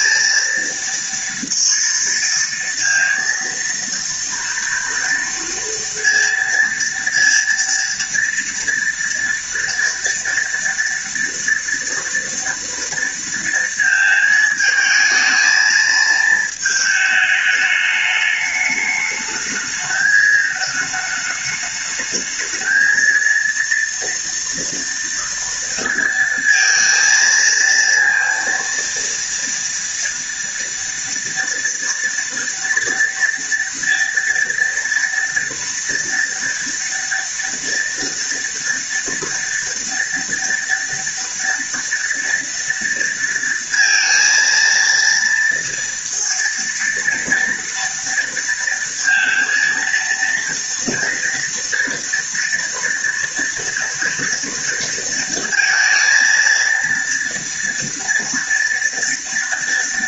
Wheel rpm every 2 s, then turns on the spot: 230, 230, 230, 230, 230, 230, 230, 220, 220, 210, 210, 230, 230, 230, 230, 230, 230, 230, 230, 230, 230, 230, 230, 230, 230, 230, 230, 230, 230, 230.
none